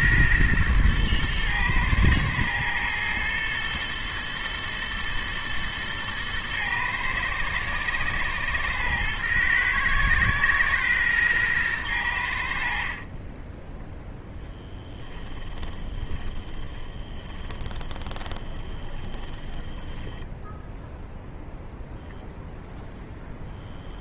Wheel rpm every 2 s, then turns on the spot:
110, 120, 110, 120, 110, 120, 50, 10, 20, 20, 10, 0.
14-22